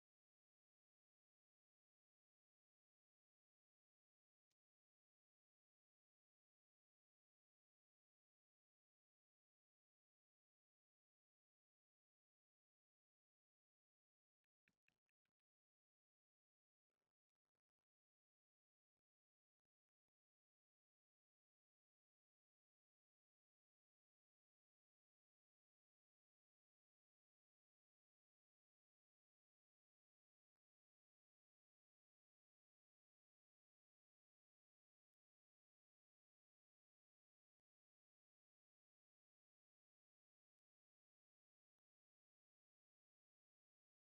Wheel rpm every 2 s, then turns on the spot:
0, 0, 0, 0, 0, 0, 0, 0, 0, 0, 0, 0, 0, 0, 0, 0, 0, 0, 0, 0, 0, 0.
none